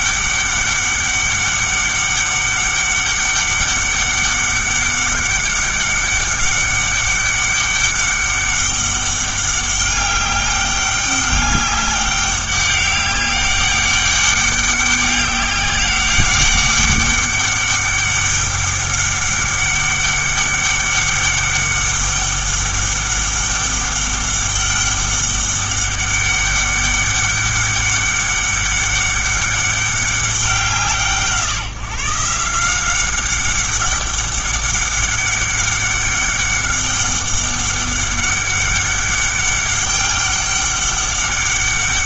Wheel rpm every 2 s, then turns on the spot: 200, 200, 200, 200, 200, 200, 200, 200, 190, 200, 200, 200, 200, 200, 200, 170, 170, 200, 200, 200, 200.
none